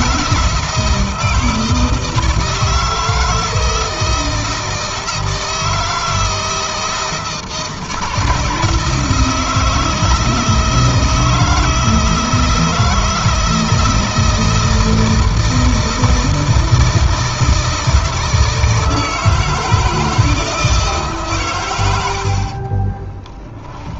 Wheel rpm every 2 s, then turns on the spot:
160, 160, 160, 160, 160, 160, 160, 160, 160, 160, 150, 50.
22-24